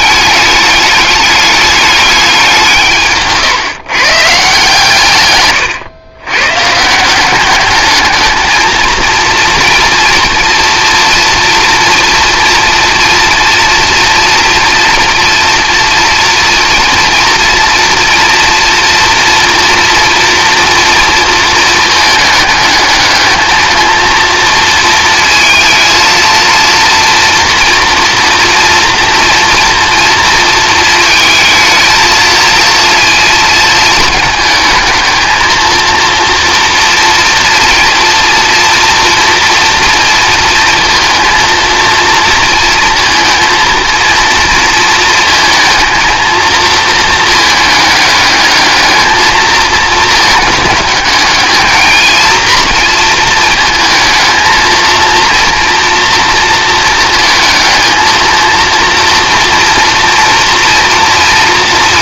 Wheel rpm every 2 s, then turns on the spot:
210, 180, 140, 130, 220, 240, 230, 230, 230, 240, 230, 210, 230, 230, 230, 230, 230, 220, 230, 230, 230, 230, 230, 230, 210, 220, 230, 220, 230, 230, 230.
none